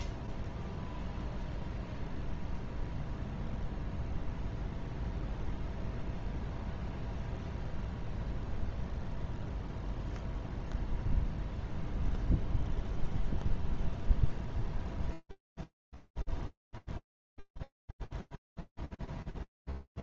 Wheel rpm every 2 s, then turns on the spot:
0, 0, 0, 0, 0, 0, 0, 0, 0, 0.
none